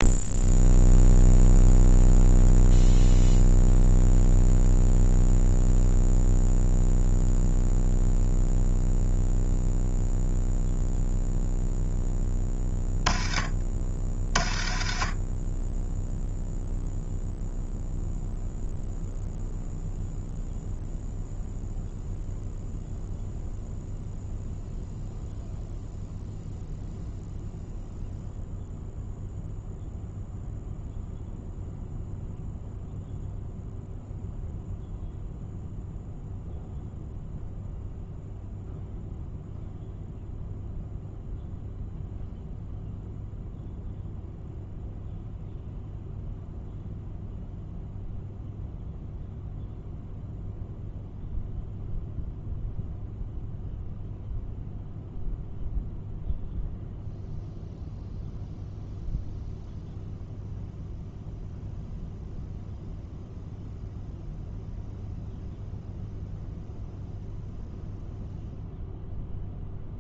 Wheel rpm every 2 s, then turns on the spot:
0, 0, 0, 0, 0, 0, 10, 40, 0, 0, 0, 0, 0, 0, 0, 0, 0, 0, 0, 0, 0, 0, 0, 0, 0, 0, 0, 0, 0, 0, 0, 0, 0, 0, 0.
none